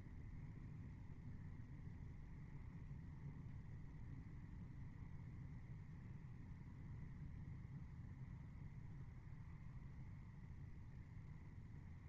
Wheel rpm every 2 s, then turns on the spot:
0, 0, 0, 0, 0, 0.
none